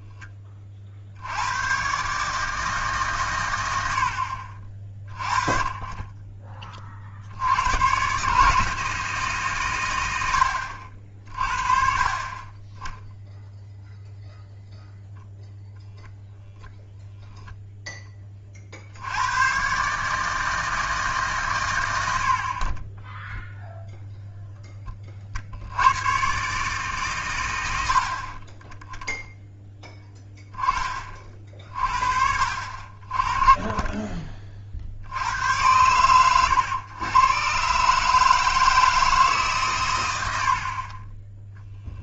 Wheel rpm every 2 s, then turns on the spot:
30, 150, 50, 30, 150, 90, 20, 0, 0, 50, 160, 30, 20, 140, 20, 20, 50, 50, 110, 160, 60.
none